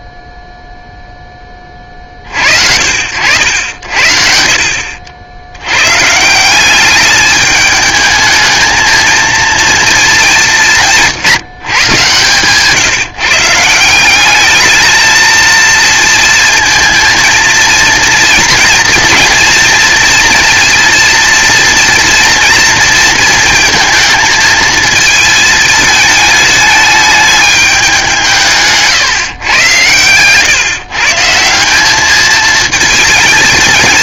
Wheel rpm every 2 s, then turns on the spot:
0, 70, 70, 200, 220, 170, 150, 220, 230, 230, 230, 230, 230, 210, 150, 140, 230.
none